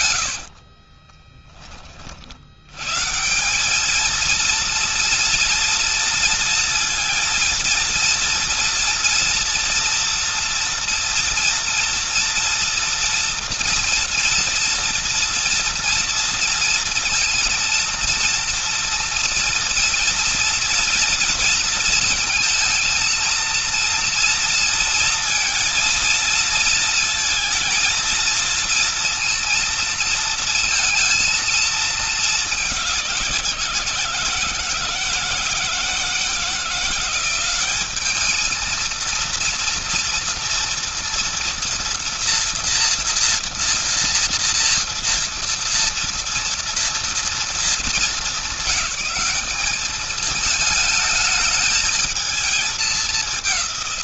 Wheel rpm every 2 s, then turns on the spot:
50, 100, 230, 230, 230, 230, 230, 230, 230, 230, 230, 230, 230, 230, 230, 230, 200, 160, 170, 220, 230, 230, 230, 230, 200, 220, 210.
0-2